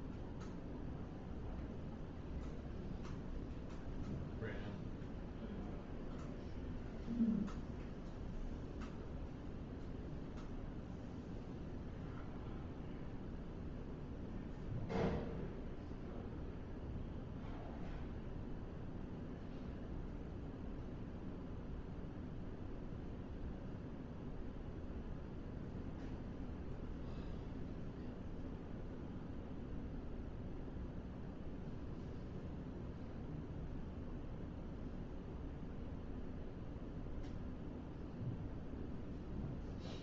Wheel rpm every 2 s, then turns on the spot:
0, 0, 0, 0, 0, 0, 0, 0, 0, 0, 0, 0, 0, 0, 0, 0, 0, 0, 0, 0.
none